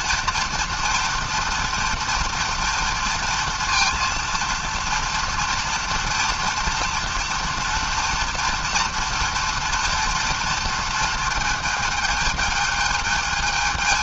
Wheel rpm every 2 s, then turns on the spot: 240, 230, 230, 230, 230, 230, 220.
none